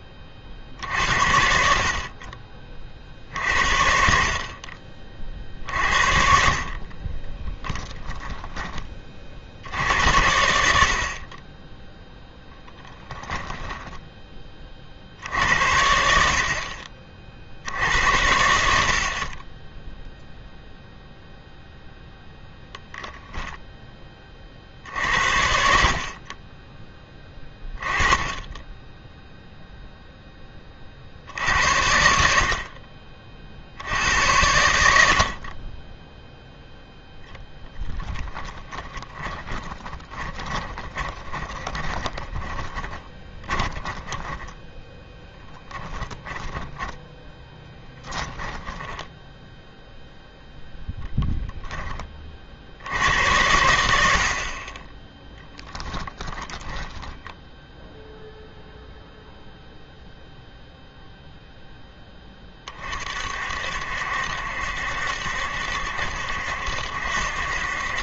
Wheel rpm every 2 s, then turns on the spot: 60, 40, 50, 60, 20, 70, 10, 40, 50, 70, 0, 10, 60, 20, 10, 20, 60, 90, 0, 20, 30, 20, 10, 10, 10, 0, 60, 30, 10, 0, 0, 30, 70, 70.
6-8 12-14 38-50